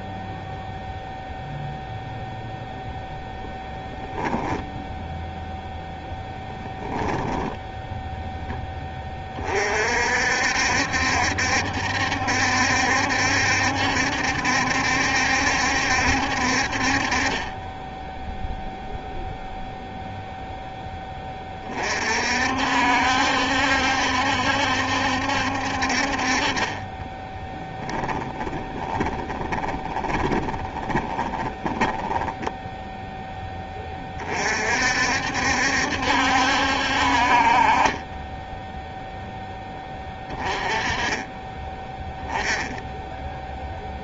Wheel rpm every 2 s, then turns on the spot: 0, 0, 0, 0, 20, 70, 70, 70, 40, 0, 10, 70, 70, 20, 20, 20, 10, 60, 60, 0, 30, 10.
28-32